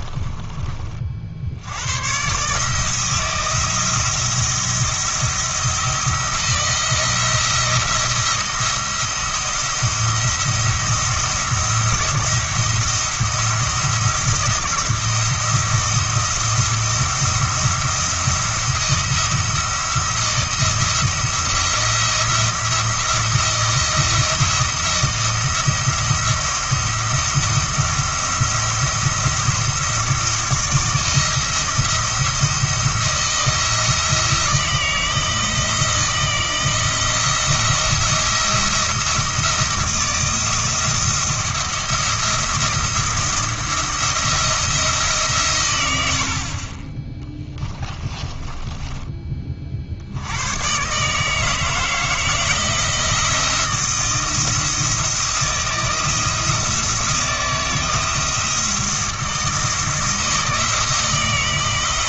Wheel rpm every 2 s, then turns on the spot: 40, 150, 170, 170, 170, 170, 170, 170, 170, 170, 170, 160, 170, 170, 170, 160, 170, 160, 160, 170, 170, 170, 160, 30, 30, 110, 160, 160, 170, 160, 160.
48-50